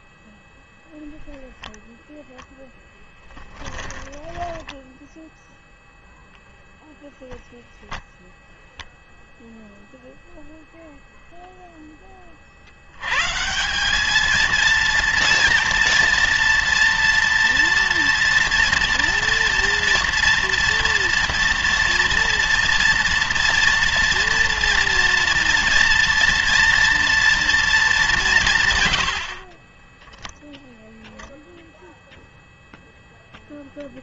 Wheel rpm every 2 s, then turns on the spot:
0, 10, 20, 0, 0, 0, 80, 230, 230, 230, 230, 230, 230, 230, 130, 0, 0.
4-6